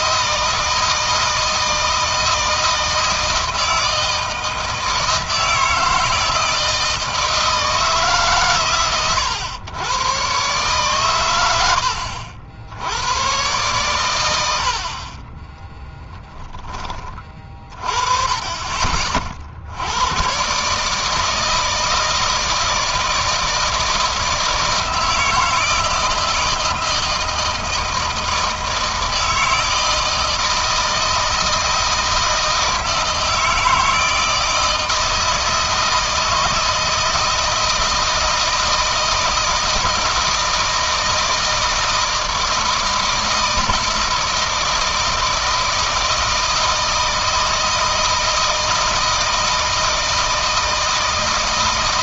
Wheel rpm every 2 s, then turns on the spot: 160, 160, 160, 160, 120, 120, 100, 50, 20, 30, 140, 160, 160, 160, 160, 160, 160, 160, 160, 160, 160, 160, 160, 160, 160, 160.
none